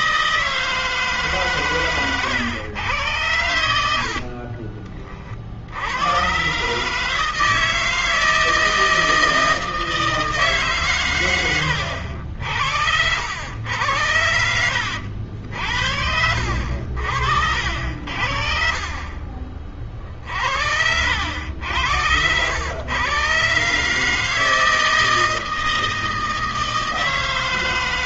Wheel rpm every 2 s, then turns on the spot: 160, 110, 60, 120, 160, 160, 70, 80, 70, 50, 50, 100, 160, 160.
4-6